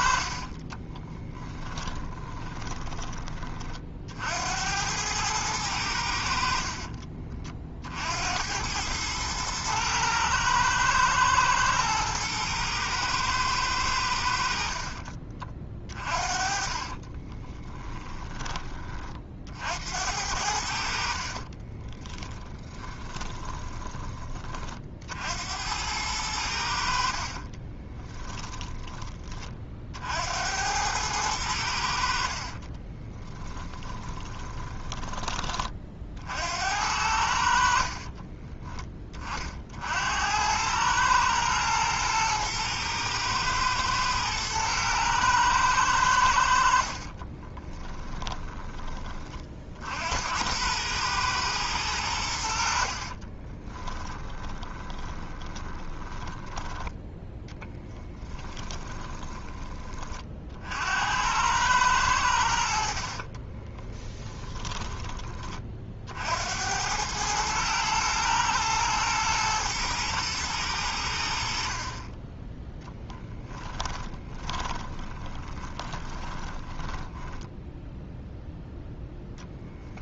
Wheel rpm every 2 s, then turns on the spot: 20, 20, 100, 40, 100, 110, 110, 40, 30, 30, 60, 20, 50, 70, 20, 100, 20, 20, 80, 20, 110, 110, 110, 50, 20, 110, 50, 30, 10, 20, 70, 50, 10, 90, 110, 100, 10, 20, 10, 0.
0-2 6-8 16-18 22-24 32-34 46-48 52-56 58-60 64-66 72-78